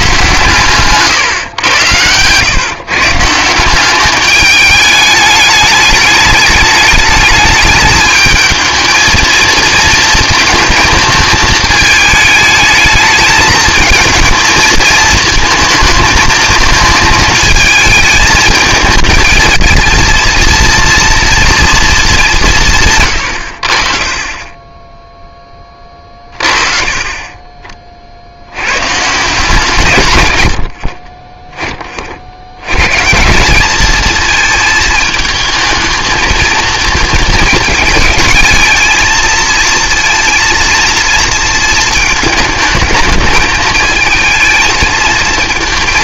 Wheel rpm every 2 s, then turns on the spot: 130, 140, 210, 210, 220, 220, 210, 220, 220, 220, 230, 170, 20, 40, 100, 70, 110, 220, 230, 220, 230, 220, 220.
none